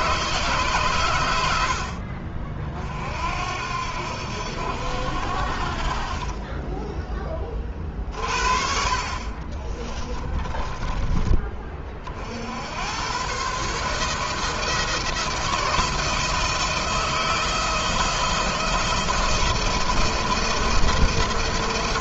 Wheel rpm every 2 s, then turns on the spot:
130, 40, 80, 20, 40, 20, 80, 160, 170, 170, 170.
6-8 10-12